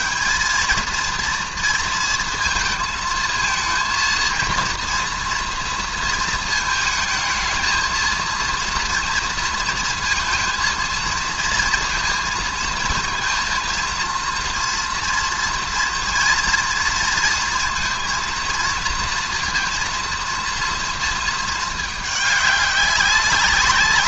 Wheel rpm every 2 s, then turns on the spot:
220, 230, 230, 230, 230, 230, 230, 230, 230, 230, 230, 200.
none